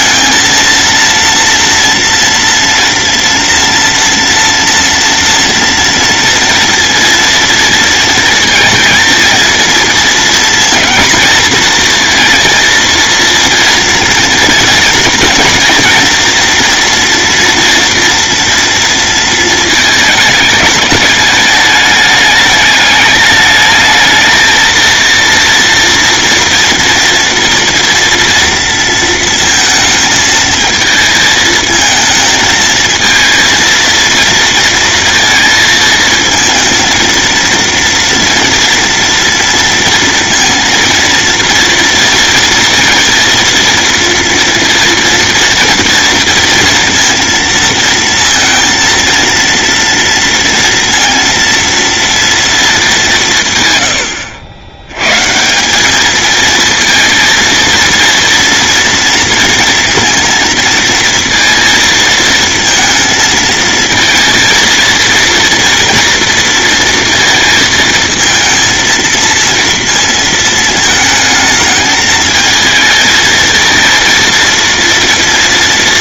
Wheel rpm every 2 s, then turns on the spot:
230, 230, 230, 230, 230, 230, 230, 230, 230, 230, 220, 210, 220, 230, 230, 220, 220, 230, 230, 230, 230, 230, 230, 230, 230, 230, 220, 90, 220, 230, 230, 230, 230, 230, 230, 220, 220, 230.
none